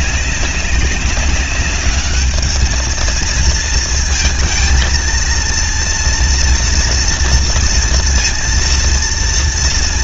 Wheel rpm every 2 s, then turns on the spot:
200, 210, 230, 240, 230.
none